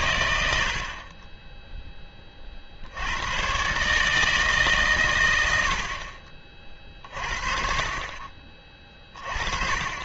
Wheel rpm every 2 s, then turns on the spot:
80, 50, 140, 40, 30.
none